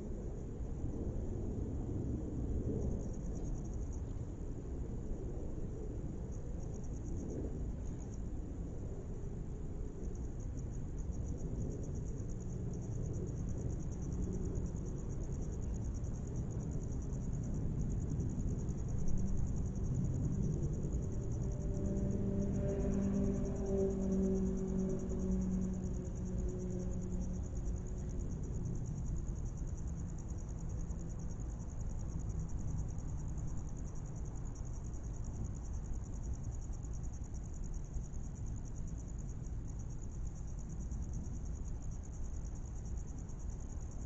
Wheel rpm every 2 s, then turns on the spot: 0, 0, 0, 0, 0, 0, 0, 0, 0, 0, 0, 0, 0, 0, 0, 0, 0, 0, 0, 0, 0, 0.
none